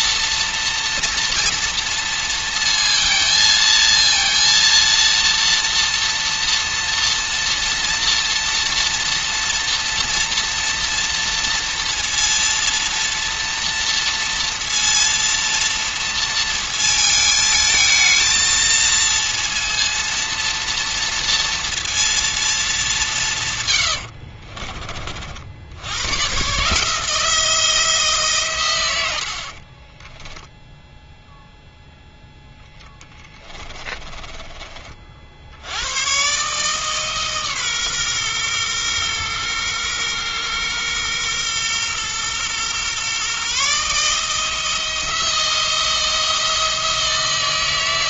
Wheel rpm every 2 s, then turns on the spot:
240, 230, 230, 230, 230, 230, 230, 230, 230, 230, 230, 220, 40, 140, 110, 0, 0, 40, 150, 120, 120, 120, 160, 160.
24-26